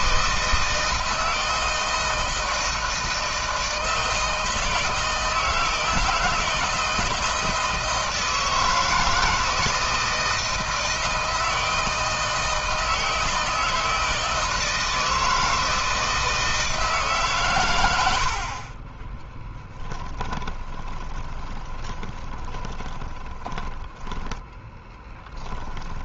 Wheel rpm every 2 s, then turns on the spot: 160, 160, 160, 160, 160, 160, 160, 160, 160, 50, 30, 20, 10.
20-26